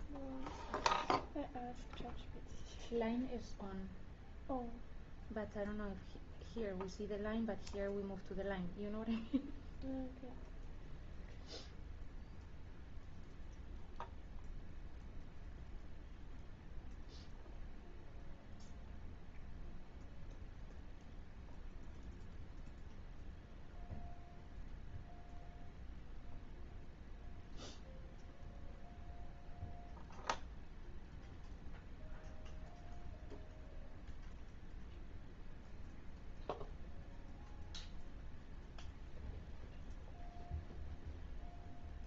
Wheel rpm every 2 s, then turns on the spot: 0, 0, 0, 0, 0, 0, 0, 0, 0, 0, 0, 0, 0, 0, 0, 0, 0, 0, 0, 0, 0.
none